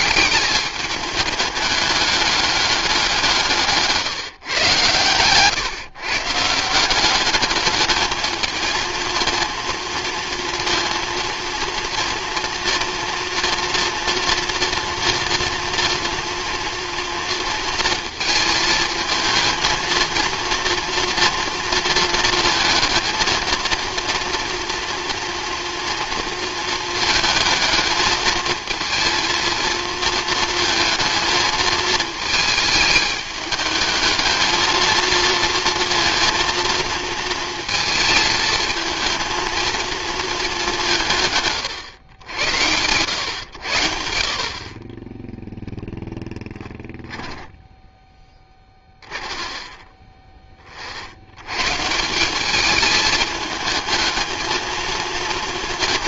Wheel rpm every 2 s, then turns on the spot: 210, 180, 120, 190, 230, 230, 230, 230, 230, 230, 230, 230, 240, 230, 230, 230, 210, 230, 230, 230, 170, 100, 30, 10, 20, 30, 210, 220.
46-50